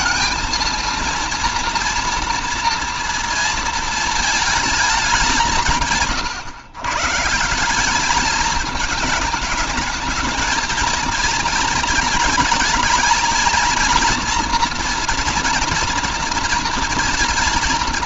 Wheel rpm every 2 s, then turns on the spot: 230, 240, 220, 130, 220, 230, 220, 240, 230.
none